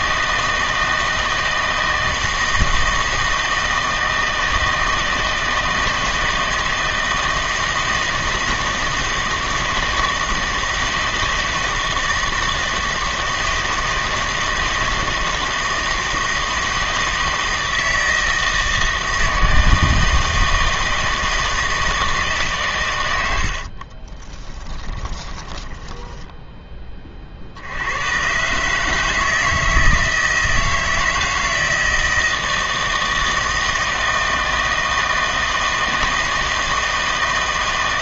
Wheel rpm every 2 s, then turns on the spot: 160, 160, 160, 160, 160, 160, 160, 160, 160, 160, 160, 130, 20, 10, 140, 160, 160, 160, 160.
24-26